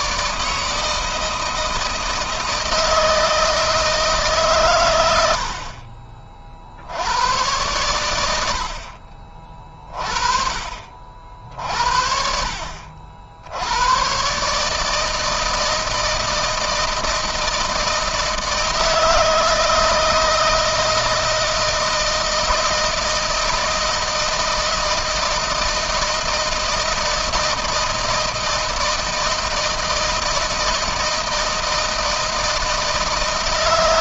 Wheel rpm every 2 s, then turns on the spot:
160, 160, 90, 90, 40, 50, 70, 160, 160, 160, 160, 160, 160, 160, 160, 160, 160.
none